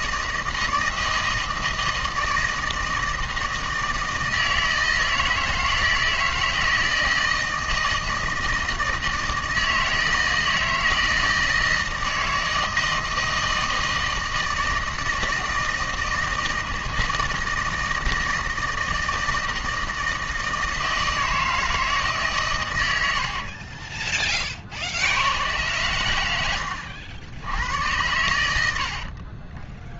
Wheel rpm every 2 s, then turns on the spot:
160, 160, 160, 160, 160, 160, 160, 160, 160, 160, 160, 110, 60, 80, 70.
none